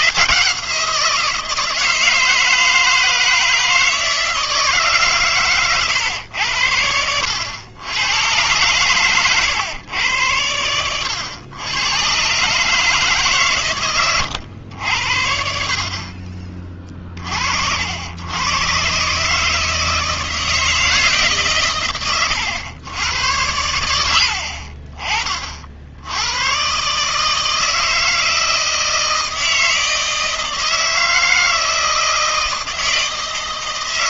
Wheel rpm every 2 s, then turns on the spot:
170, 160, 160, 80, 110, 90, 150, 100, 30, 120, 160, 100, 50, 120, 160, 160, 160.
none